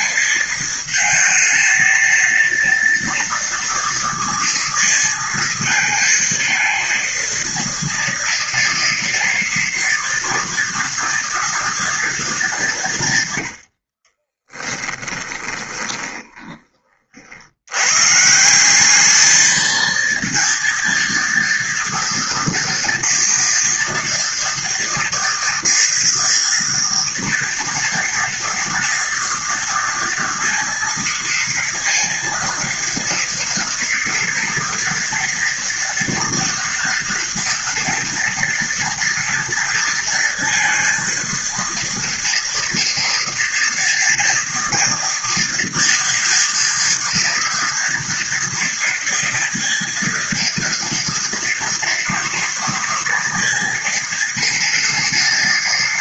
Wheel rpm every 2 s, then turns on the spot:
230, 230, 230, 230, 230, 230, 210, 30, 20, 170, 230, 230, 230, 230, 230, 230, 230, 230, 230, 230, 230, 230, 230, 230, 230, 230, 230, 230.
14-16